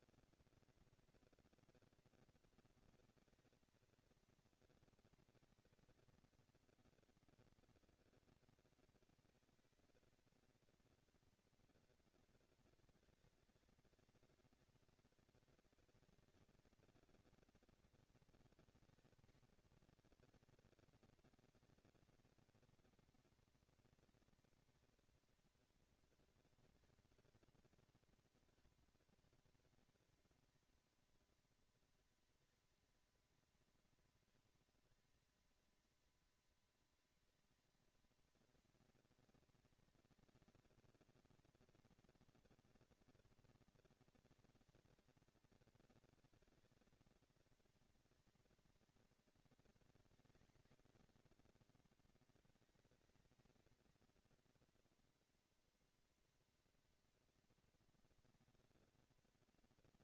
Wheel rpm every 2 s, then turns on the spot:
230, 230, 230, 230, 230, 230, 230, 230, 230, 230, 220, 230, 230, 240, 230, 220, 220, 220, 220, 220, 230, 230, 230, 220, 230, 240, 210, 230, 230, 230.
none